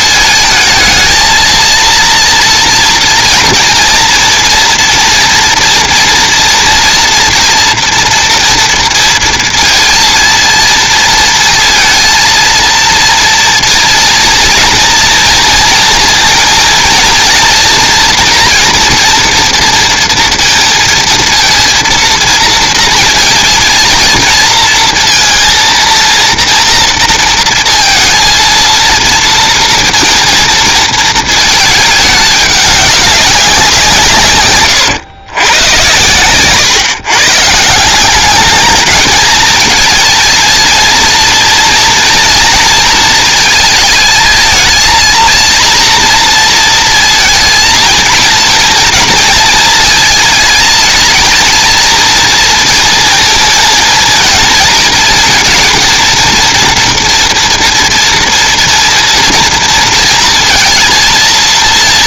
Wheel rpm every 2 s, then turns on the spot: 230, 230, 230, 230, 230, 230, 230, 230, 230, 230, 230, 220, 230, 230, 230, 230, 200, 110, 140, 220, 230, 220, 230, 230, 230, 220, 230, 230, 240, 230, 220.
none